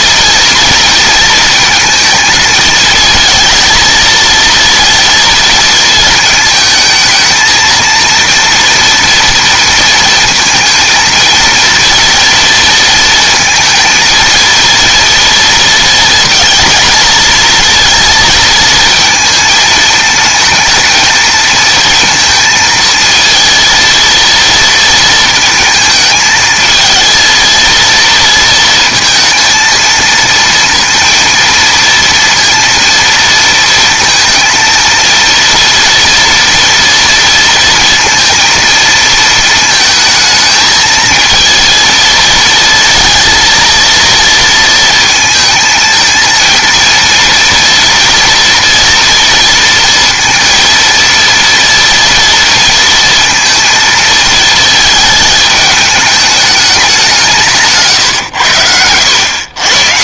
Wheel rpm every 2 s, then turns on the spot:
230, 220, 230, 220, 230, 220, 230, 230, 230, 230, 230, 230, 230, 220, 230, 230, 230, 230, 230, 230, 220, 230, 230, 230, 230, 230, 230, 220, 210, 90.
none